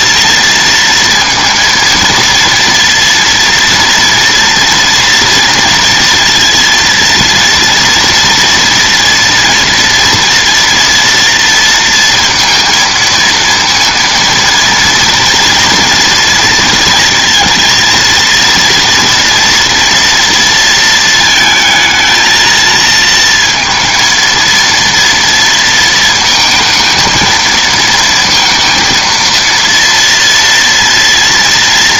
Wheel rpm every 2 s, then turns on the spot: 230, 230, 230, 230, 240, 230, 220, 230, 230, 230, 230, 220, 230, 230, 230, 230.
none